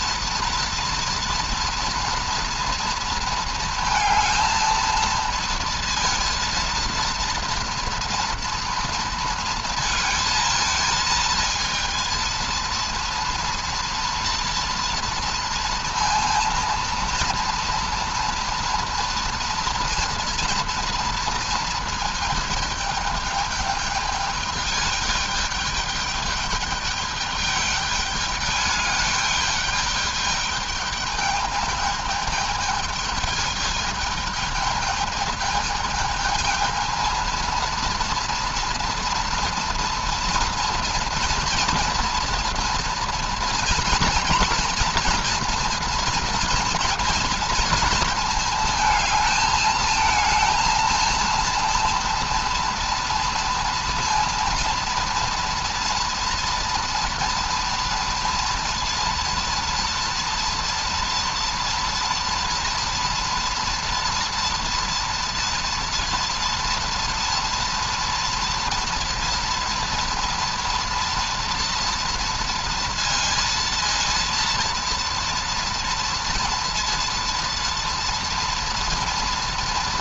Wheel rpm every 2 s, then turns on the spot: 230, 230, 220, 230, 230, 230, 230, 230, 230, 230, 230, 220, 210, 210, 210, 210, 220, 220, 230, 240, 230, 230, 230, 230, 220, 230, 230, 230, 230, 230, 230, 230, 230, 230, 230, 240, 230, 230, 230, 230.
none